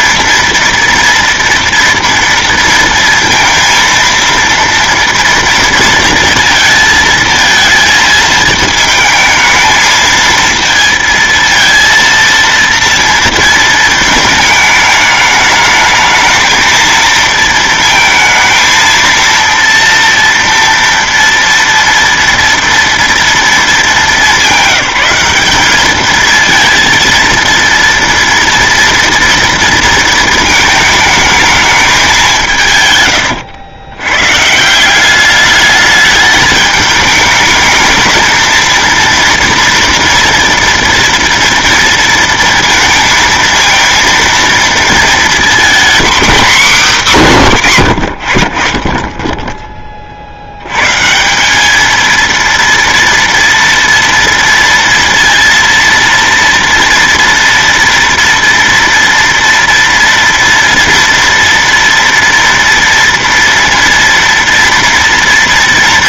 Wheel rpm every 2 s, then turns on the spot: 230, 230, 230, 230, 220, 230, 230, 220, 220, 230, 240, 230, 200, 220, 230, 230, 170, 160, 210, 230, 230, 230, 230, 250, 50, 90, 230, 230, 230, 230, 230, 230, 230.
none